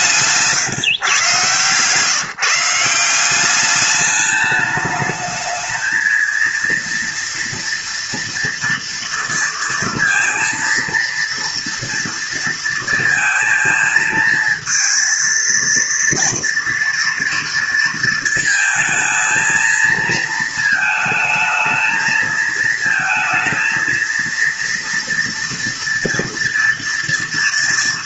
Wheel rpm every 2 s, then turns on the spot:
140, 170, 210, 230, 230, 230, 230, 230, 230, 220, 220, 220, 230, 230.
none